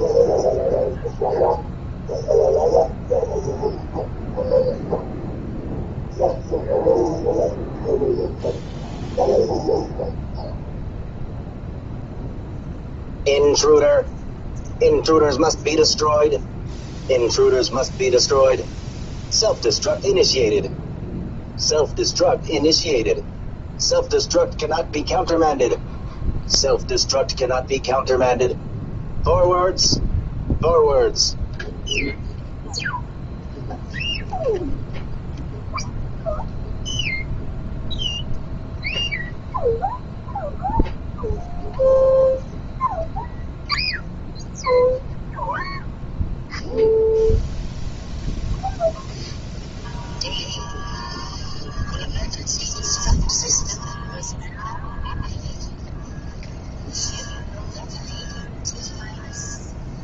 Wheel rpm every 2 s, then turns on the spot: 0, 0, 0, 0, 0, 0, 0, 0, 0, 0, 0, 0, 0, 0, 0, 0, 0, 0, 0, 0, 0, 0, 0, 0, 0, 0, 0, 0, 0, 0.
none